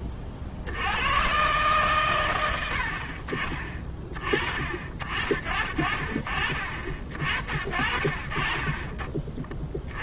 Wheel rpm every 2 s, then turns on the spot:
80, 60, 50, 50, 20.
none